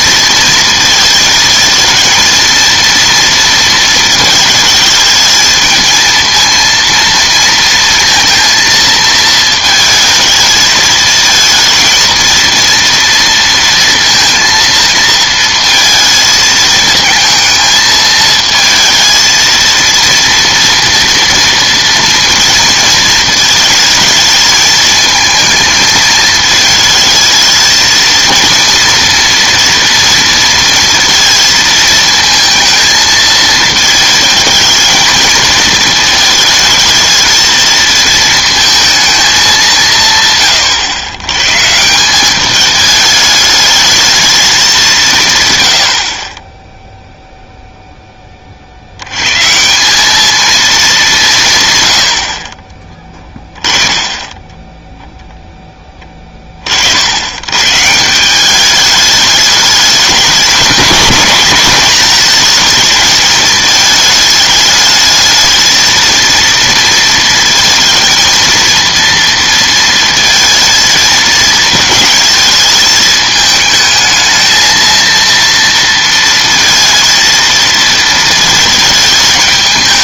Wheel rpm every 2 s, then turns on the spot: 220, 230, 220, 230, 230, 220, 230, 230, 220, 220, 230, 230, 220, 220, 230, 230, 220, 220, 220, 230, 110, 210, 200, 10, 50, 210, 30, 10, 50, 200, 210, 220, 210, 230, 230, 220, 220, 220, 230, 220.
none